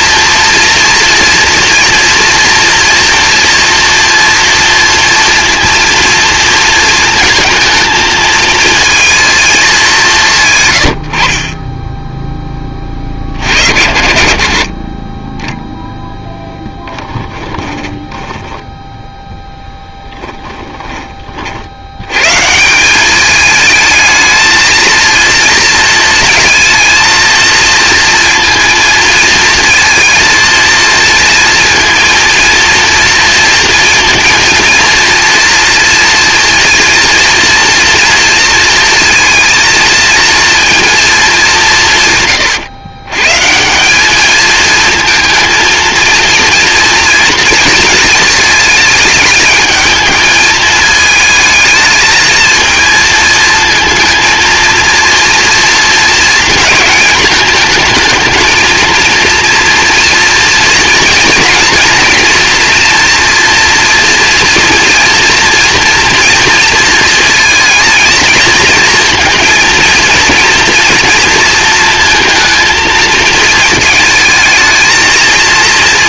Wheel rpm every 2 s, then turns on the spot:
240, 230, 230, 230, 220, 120, 20, 40, 10, 10, 10, 150, 220, 230, 230, 230, 230, 230, 230, 230, 230, 130, 220, 230, 220, 220, 220, 230, 230, 220, 230, 230, 230, 230, 220, 230, 230, 220.
16-22